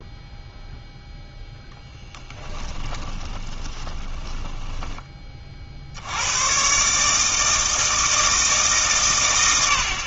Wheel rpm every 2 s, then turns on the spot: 0, 20, 20, 140, 140.
2-4